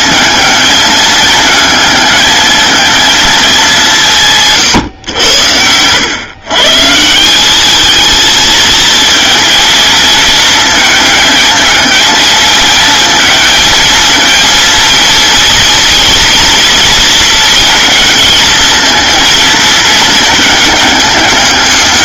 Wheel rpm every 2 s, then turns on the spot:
220, 220, 100, 180, 230, 220, 220, 230, 230, 230, 210.
none